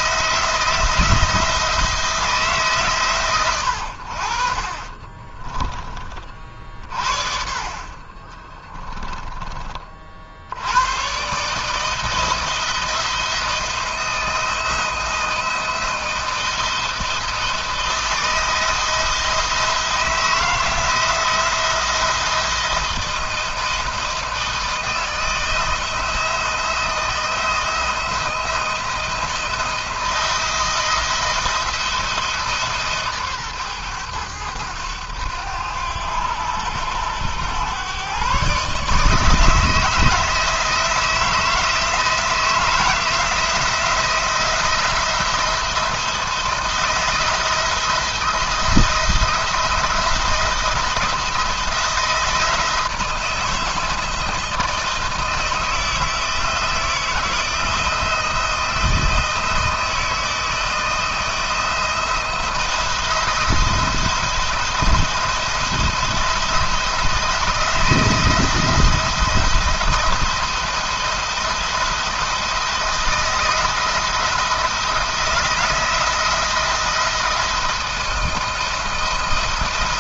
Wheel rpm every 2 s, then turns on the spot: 170, 140, 40, 50, 10, 90, 170, 160, 170, 170, 170, 170, 160, 160, 170, 170, 150, 100, 100, 140, 160, 170, 170, 160, 170, 170, 160, 160, 170, 170, 160, 170, 170, 160, 170, 170, 170, 160, 170, 160.
4-6 8-10